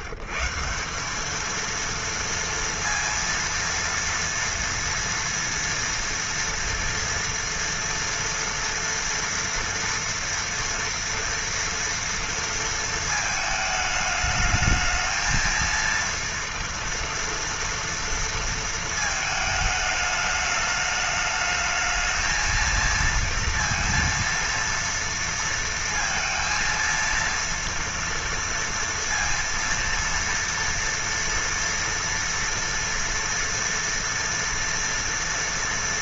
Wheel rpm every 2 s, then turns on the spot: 150, 230, 230, 230, 230, 230, 230, 210, 230, 230, 210, 220, 230, 230, 230, 230, 230, 240.
none